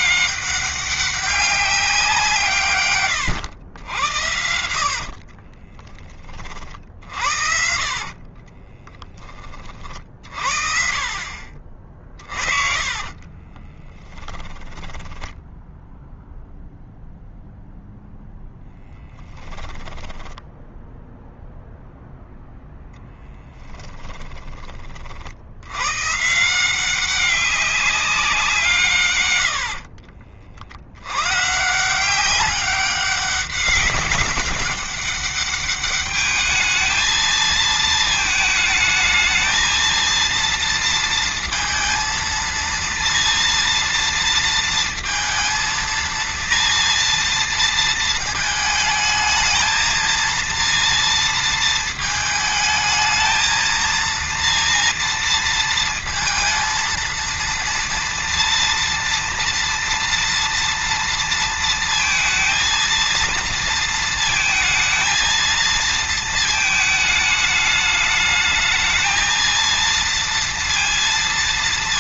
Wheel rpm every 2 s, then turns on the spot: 200, 120, 70, 60, 20, 50, 40, 10, 0, 0, 0, 10, 30, 170, 160, 100, 190, 200, 220, 220, 230, 230, 230, 230, 220, 230, 220, 230, 230, 230, 230, 230, 220, 220, 220, 230.
2-10 12-16